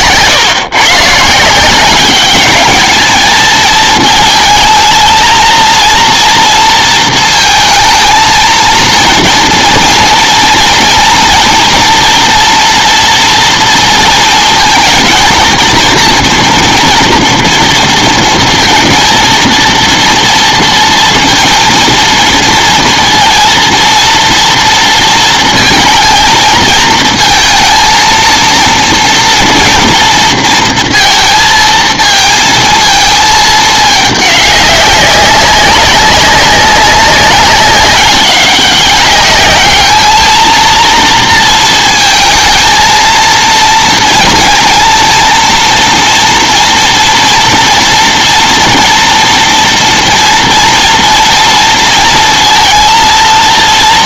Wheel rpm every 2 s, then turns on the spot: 130, 200, 230, 230, 230, 230, 230, 230, 240, 230, 230, 230, 230, 220, 230, 230, 220, 200, 200, 190, 230, 220, 230, 230, 230, 230, 230.
none